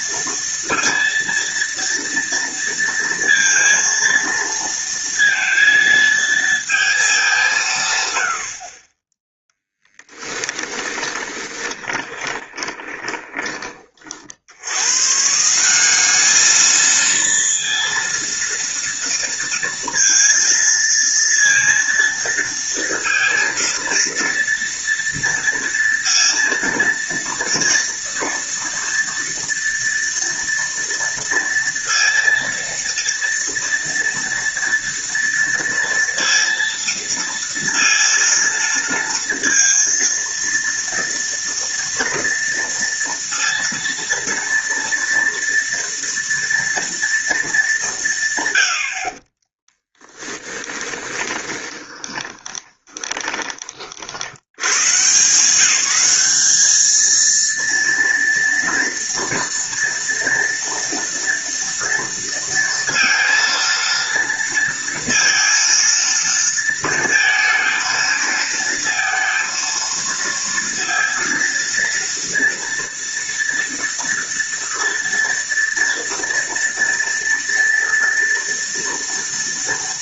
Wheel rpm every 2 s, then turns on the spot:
230, 230, 230, 220, 40, 10, 20, 100, 220, 230, 230, 230, 230, 230, 230, 230, 230, 230, 230, 230, 230, 230, 230, 230, 70, 20, 20, 130, 220, 230, 230, 230, 230, 230, 230, 230, 230, 230, 230, 230.
10-14 50-54